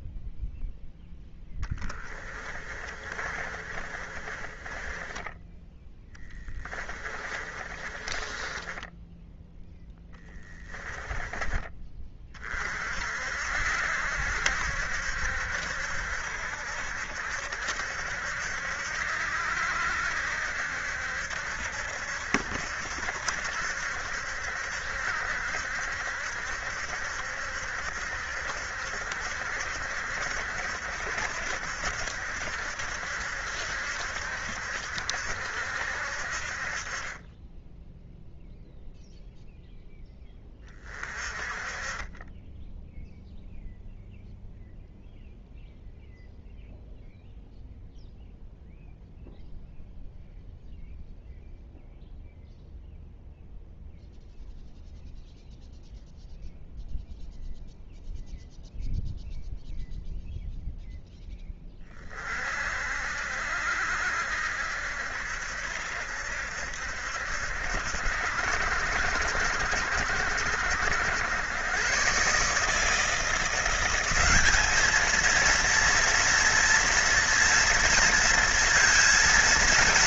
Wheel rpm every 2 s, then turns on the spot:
0, 30, 20, 20, 10, 20, 50, 70, 70, 70, 70, 70, 70, 70, 70, 70, 70, 70, 30, 0, 30, 0, 0, 0, 0, 0, 0, 0, 0, 0, 0, 60, 70, 70, 70, 80, 160, 220, 230, 230.
2-12